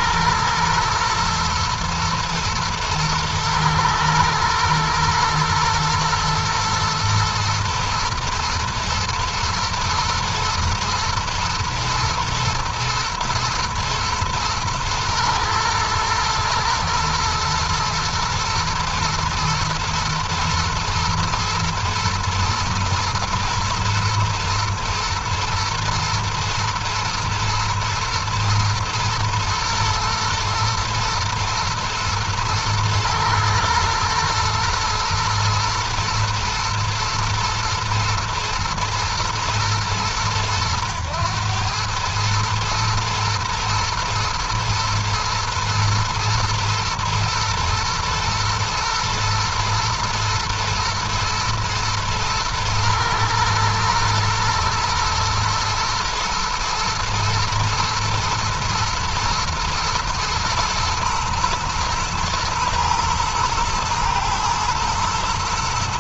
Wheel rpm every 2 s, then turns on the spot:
120, 110, 120, 120, 120, 120, 120, 110, 120, 110, 120, 110, 120, 110, 110, 110, 110, 120, 120, 110, 100, 110, 110, 110, 120, 120, 110, 120, 120, 110, 120, 110, 110.
none